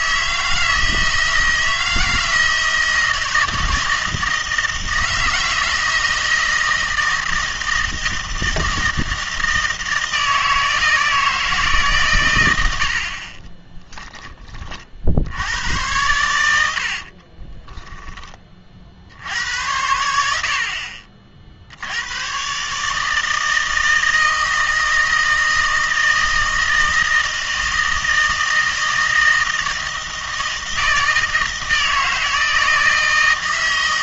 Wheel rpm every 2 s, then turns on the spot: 160, 160, 160, 160, 160, 160, 90, 50, 70, 50, 50, 140, 160, 160, 160, 160, 160.
16-18